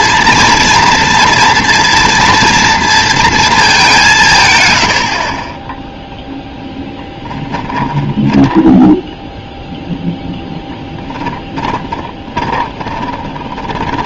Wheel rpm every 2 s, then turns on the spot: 230, 230, 100, 10, 0, 10, 30.
12-14